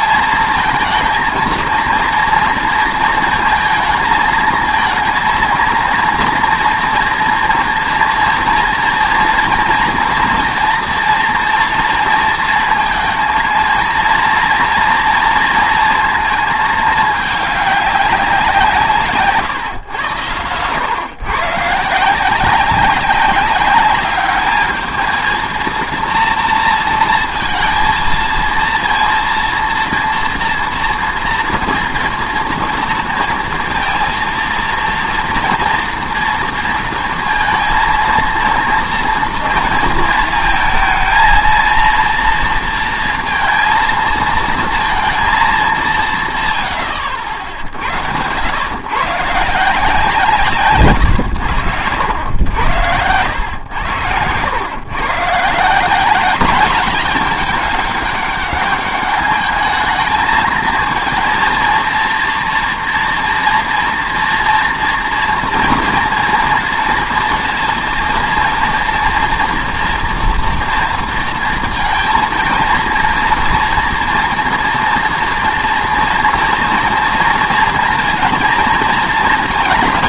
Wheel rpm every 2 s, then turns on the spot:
220, 230, 220, 230, 230, 230, 230, 230, 220, 160, 120, 190, 210, 230, 230, 240, 230, 230, 230, 230, 220, 230, 230, 100, 110, 140, 90, 120, 210, 200, 220, 230, 230, 230, 230, 230, 230, 230, 240, 230.
none